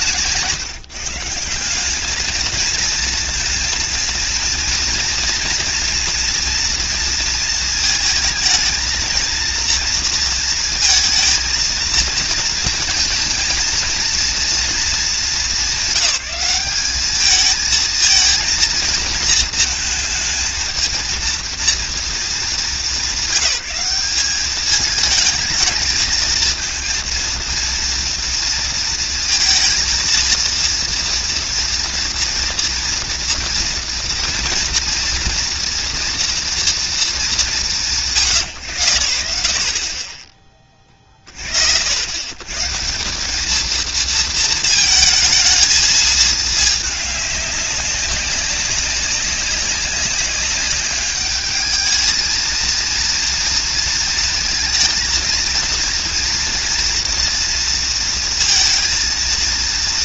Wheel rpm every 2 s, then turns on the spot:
140, 220, 230, 230, 230, 230, 230, 230, 190, 230, 230, 210, 210, 220, 230, 230, 230, 230, 240, 90, 30, 120, 220, 210, 190, 200, 230, 230, 230, 230.
none